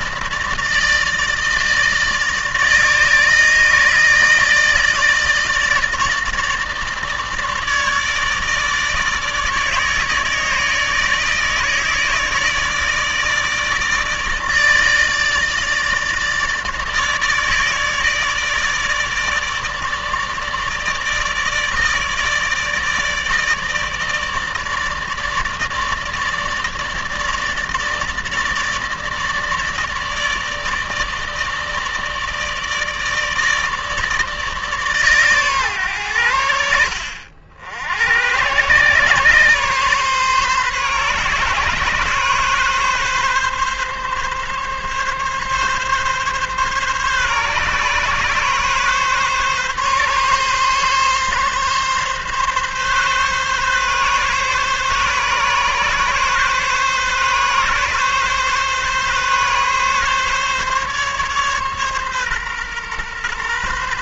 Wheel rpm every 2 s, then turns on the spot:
160, 150, 160, 150, 160, 160, 150, 160, 150, 150, 150, 150, 160, 150, 150, 150, 150, 140, 70, 130, 130, 140, 140, 140, 140, 140, 140, 140, 140, 140, 140, 130.
none